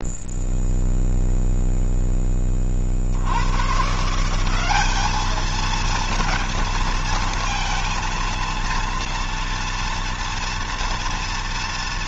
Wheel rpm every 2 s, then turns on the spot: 0, 40, 190, 230, 230, 230.
none